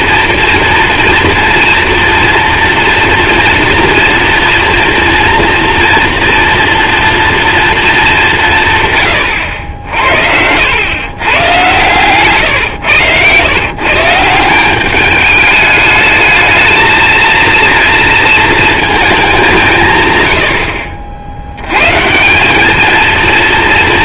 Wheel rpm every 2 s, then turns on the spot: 230, 230, 240, 240, 150, 100, 110, 180, 220, 220, 80, 200.
12-14